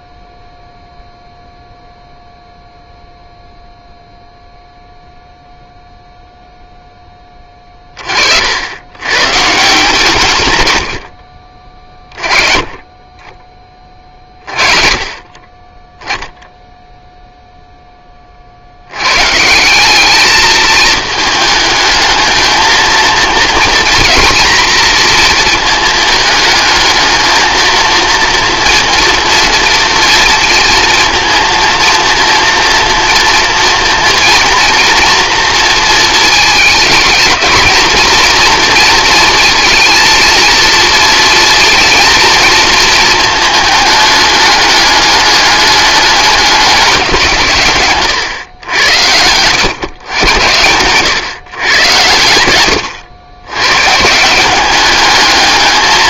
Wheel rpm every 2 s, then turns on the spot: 0, 0, 0, 0, 80, 100, 30, 40, 0, 60, 220, 220, 240, 220, 230, 230, 230, 240, 220, 230, 230, 230, 210, 200, 100, 120, 90, 200.
52-54